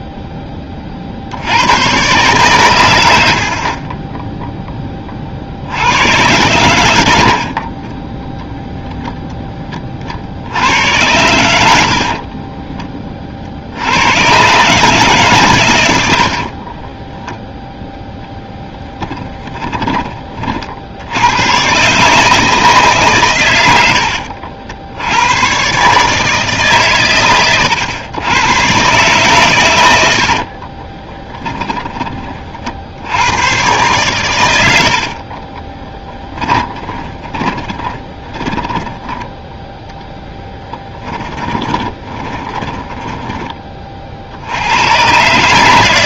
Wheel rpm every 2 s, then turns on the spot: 40, 70, 30, 70, 0, 90, 20, 140, 30, 10, 60, 150, 70, 140, 130, 30, 50, 90, 20, 20, 10, 20, 90.
16-20 30-32 36-44